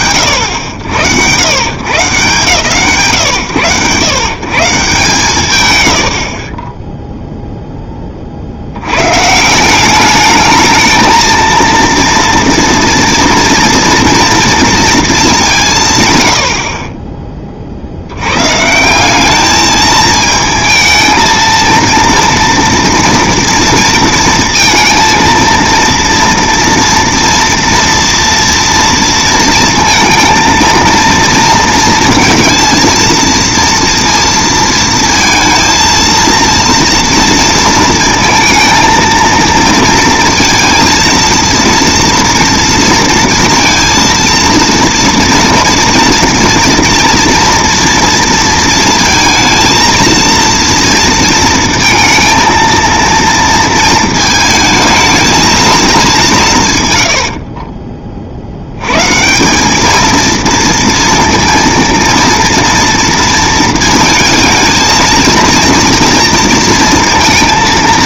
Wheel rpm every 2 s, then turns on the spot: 90, 120, 140, 0, 100, 220, 230, 220, 20, 170, 220, 230, 230, 230, 230, 230, 230, 230, 230, 230, 230, 230, 230, 230, 230, 230, 230, 220, 120, 90, 230, 230, 230, 230.
none